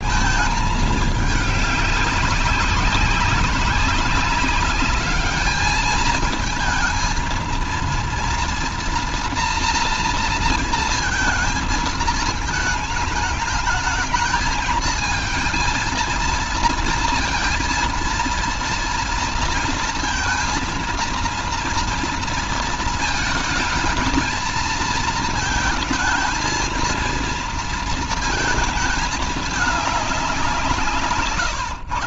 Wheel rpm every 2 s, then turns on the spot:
220, 190, 200, 220, 230, 230, 220, 220, 230, 230, 230, 230, 220, 220, 220, 170.
none